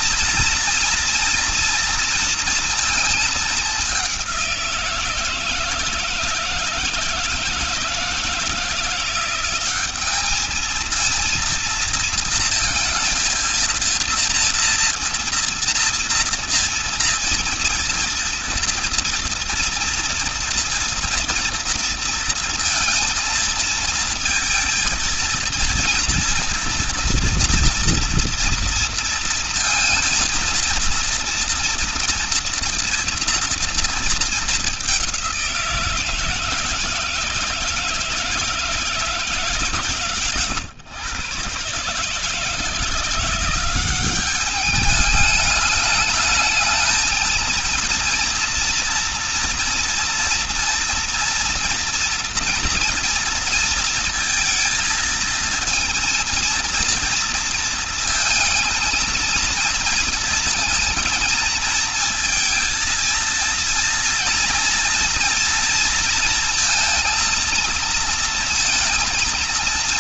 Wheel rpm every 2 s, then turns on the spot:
240, 220, 170, 160, 180, 230, 230, 230, 230, 230, 240, 230, 230, 230, 230, 230, 230, 200, 160, 160, 130, 160, 200, 220, 240, 230, 230, 230, 230, 220, 230, 230, 230, 230, 230.
none